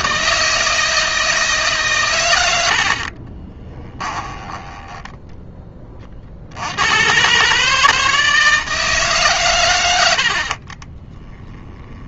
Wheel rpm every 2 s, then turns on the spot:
160, 60, 10, 100, 150, 20.
2-6 10-12